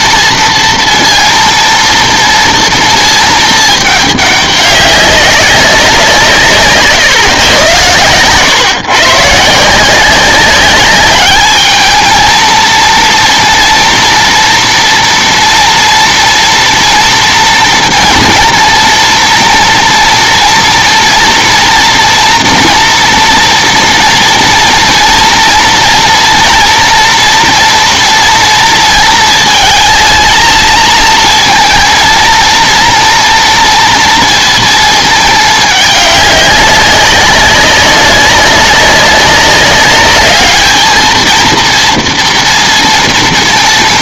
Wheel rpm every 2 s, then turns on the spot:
230, 230, 200, 150, 130, 190, 230, 230, 230, 230, 230, 230, 230, 230, 230, 220, 230, 230, 200, 200, 210, 230.
none